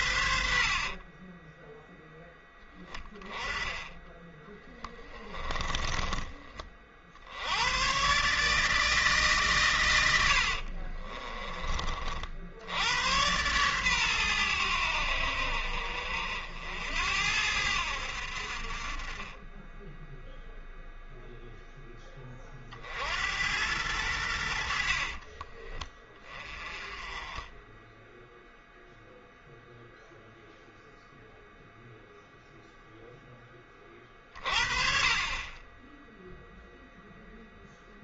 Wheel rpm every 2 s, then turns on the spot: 50, 10, 20, 40, 150, 40, 90, 90, 80, 40, 0, 50, 50, 20, 0, 0, 0, 30, 0.
0-6 10-12 24-26